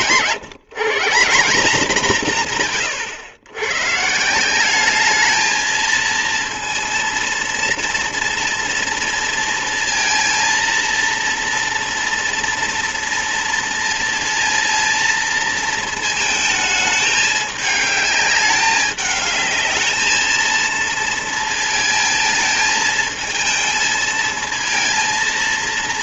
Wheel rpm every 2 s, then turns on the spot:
160, 140, 190, 230, 230, 230, 230, 230, 220, 210, 230, 220, 230.
none